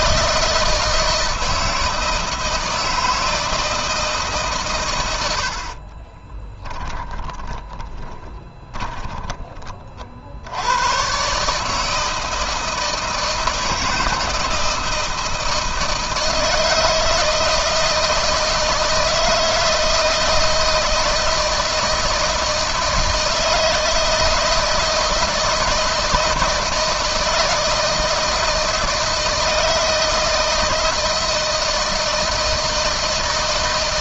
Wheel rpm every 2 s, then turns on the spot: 160, 160, 110, 10, 20, 110, 160, 160, 160, 160, 160, 160, 160, 160, 160, 160, 160.
6-10